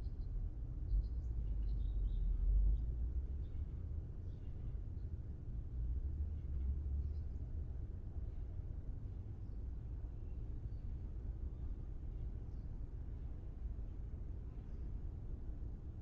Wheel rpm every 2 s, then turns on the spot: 0, 0, 0, 0, 0, 0, 0, 0.
none